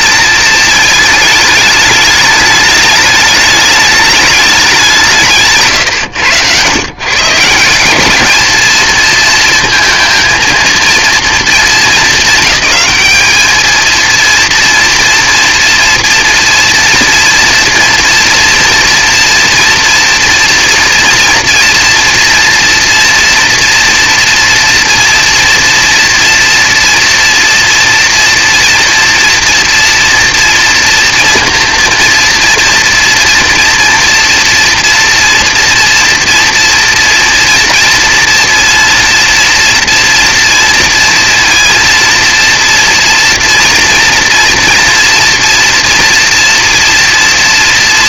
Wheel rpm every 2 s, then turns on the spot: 220, 210, 200, 110, 220, 230, 210, 230, 230, 230, 230, 230, 230, 230, 230, 230, 240, 240, 240, 230, 230, 230, 230, 230.
none